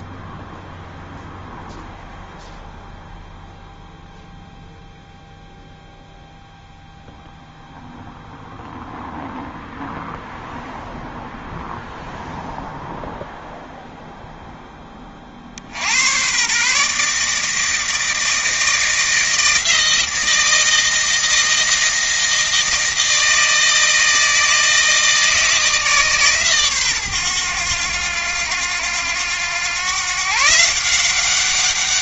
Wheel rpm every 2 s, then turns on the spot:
0, 0, 0, 0, 0, 0, 0, 10, 140, 160, 160, 160, 160, 130, 90, 160.
none